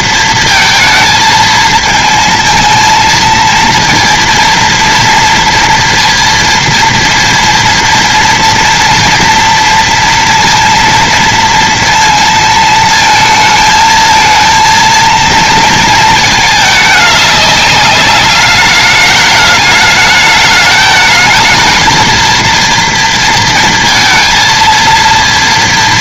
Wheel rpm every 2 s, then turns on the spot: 220, 220, 230, 230, 230, 230, 220, 230, 210, 210, 220, 230, 230.
none